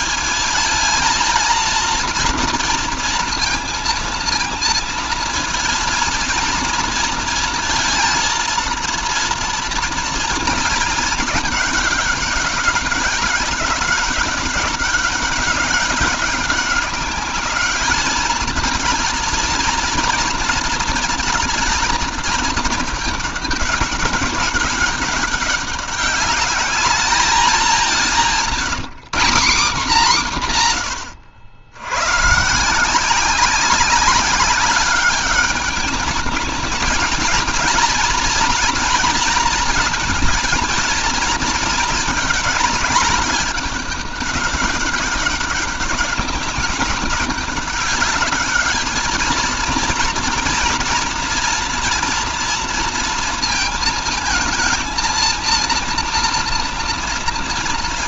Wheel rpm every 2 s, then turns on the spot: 230, 230, 230, 230, 230, 220, 200, 200, 200, 220, 230, 210, 200, 210, 190, 170, 170, 200, 220, 230, 230, 210, 200, 200, 210, 230, 230, 220, 230.
none